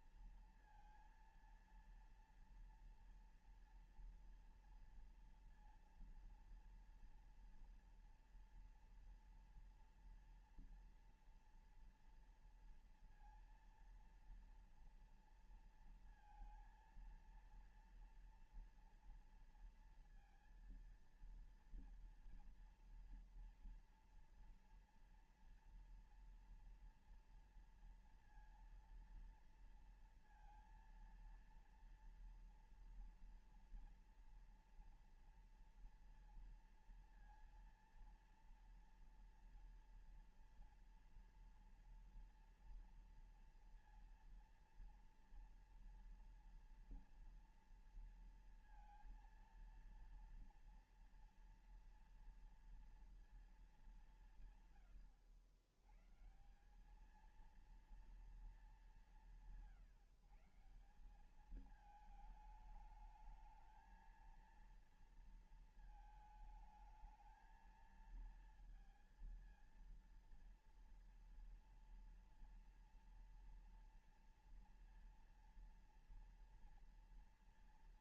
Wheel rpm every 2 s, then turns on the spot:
230, 230, 230, 230, 230, 230, 230, 230, 230, 230, 230, 230, 230, 230, 230, 230, 230, 230, 230, 230, 230, 230, 230, 230, 230, 230, 230, 160, 130, 230, 160, 210, 220, 220, 230, 230, 230, 230, 230.
none